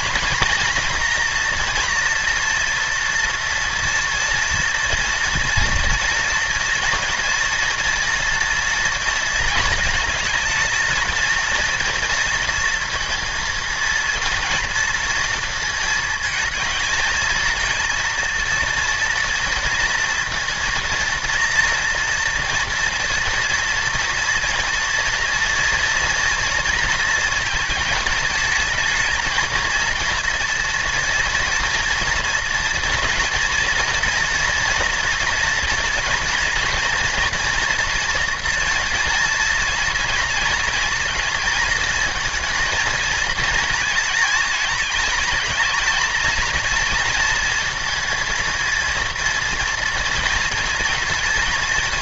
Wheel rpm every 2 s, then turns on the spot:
230, 230, 230, 230, 230, 220, 230, 230, 220, 230, 230, 230, 230, 230, 220, 240, 240, 230, 230, 230, 220, 230, 220, 230, 230, 230.
none